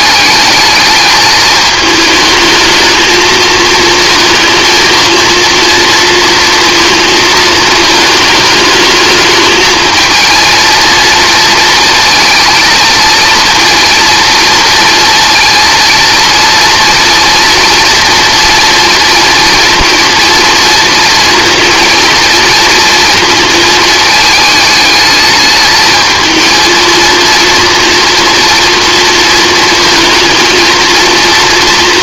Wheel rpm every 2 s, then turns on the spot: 210, 220, 230, 230, 220, 230, 230, 230, 230, 240, 230, 230, 220, 220, 230, 230.
none